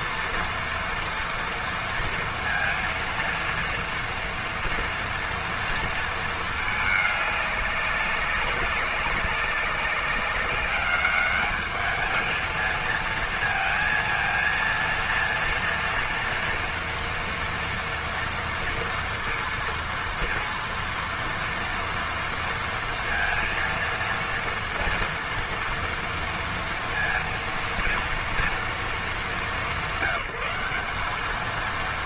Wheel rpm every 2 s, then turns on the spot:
230, 230, 230, 210, 200, 200, 230, 230, 230, 230, 230, 230, 230, 230, 200, 200.
none